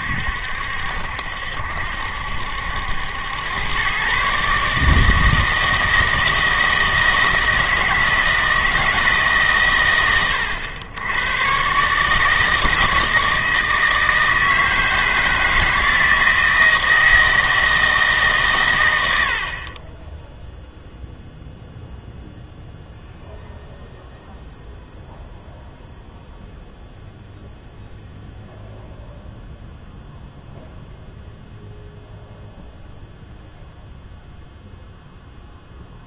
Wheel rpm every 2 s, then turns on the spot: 60, 80, 150, 160, 160, 90, 160, 160, 160, 120, 0, 0, 0, 0, 0, 0, 0, 0.
none